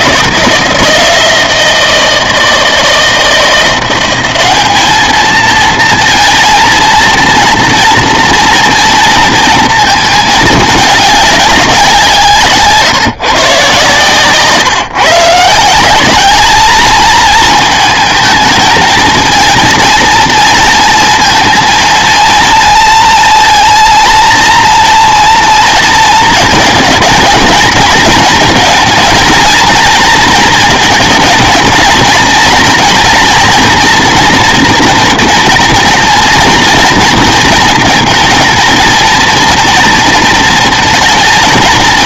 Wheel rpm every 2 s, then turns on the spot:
170, 160, 210, 230, 230, 210, 160, 140, 220, 220, 230, 230, 230, 220, 220, 230, 240, 230, 230, 230, 210.
none